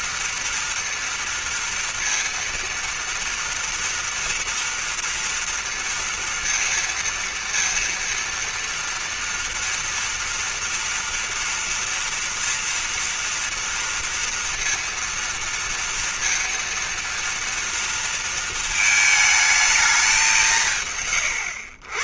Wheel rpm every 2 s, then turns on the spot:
230, 240, 230, 230, 230, 230, 230, 230, 230, 220, 170.
none